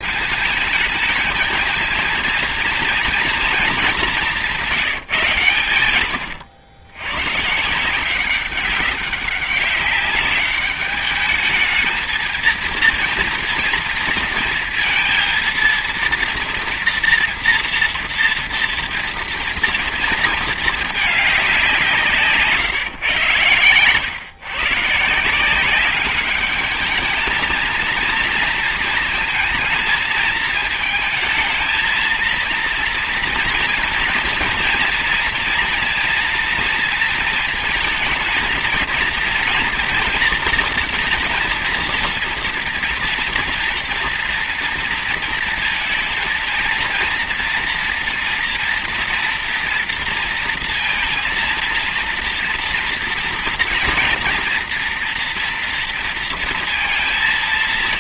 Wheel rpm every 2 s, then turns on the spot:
220, 230, 160, 110, 190, 210, 230, 230, 230, 230, 210, 130, 160, 220, 230, 220, 230, 230, 230, 230, 230, 240, 230, 230, 230, 230, 230, 230, 230.
none